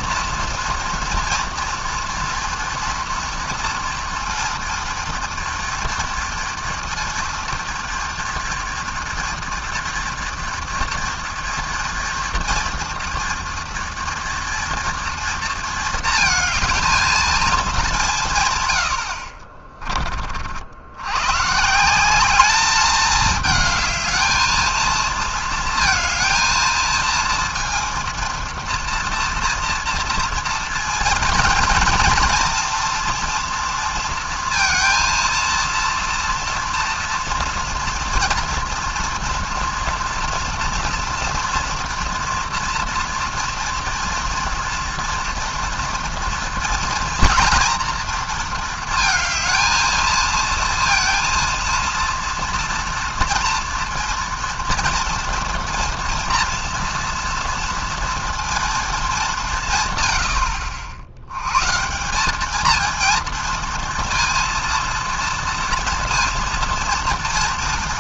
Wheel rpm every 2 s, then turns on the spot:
230, 240, 230, 230, 240, 230, 230, 230, 220, 120, 60, 210, 220, 230, 230, 230, 230, 230, 230, 230, 230, 230, 230, 230, 230, 230, 230, 230, 230, 230, 70, 210, 230, 230.
none